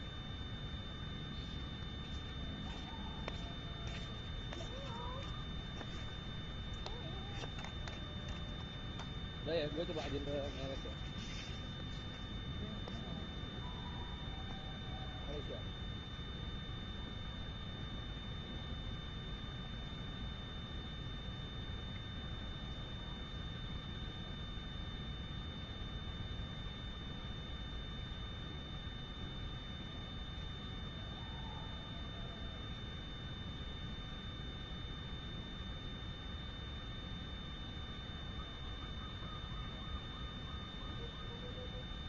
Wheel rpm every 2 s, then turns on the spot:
0, 0, 0, 0, 0, 0, 0, 0, 0, 0, 0, 0, 0, 0, 0, 0, 0, 0, 0, 0, 0.
none